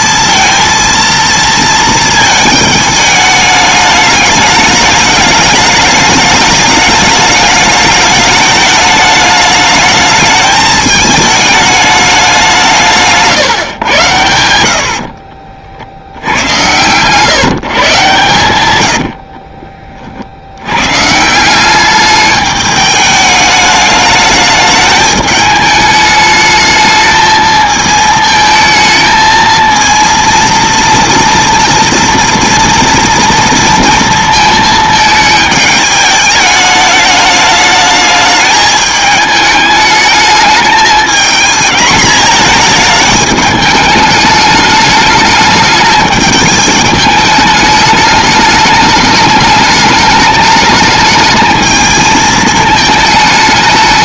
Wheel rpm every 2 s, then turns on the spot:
230, 220, 210, 210, 210, 210, 170, 90, 90, 120, 110, 210, 210, 220, 220, 230, 230, 220, 210, 210, 210, 220, 210, 220, 210, 210, 220.
none